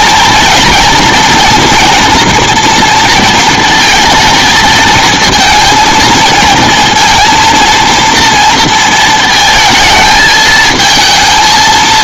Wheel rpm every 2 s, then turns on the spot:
240, 230, 220, 230, 230, 220.
none